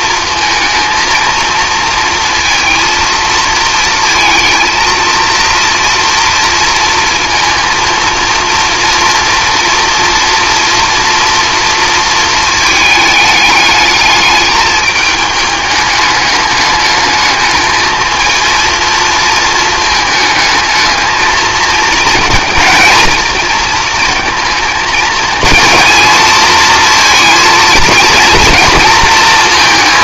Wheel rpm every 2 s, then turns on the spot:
230, 230, 230, 230, 230, 230, 220, 210, 210, 230, 220, 230, 230, 230, 230.
none